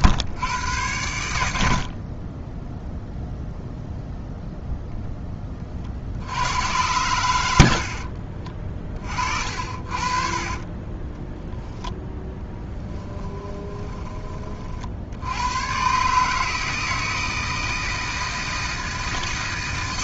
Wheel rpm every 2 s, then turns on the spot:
110, 0, 0, 100, 30, 20, 10, 60, 160, 160.
none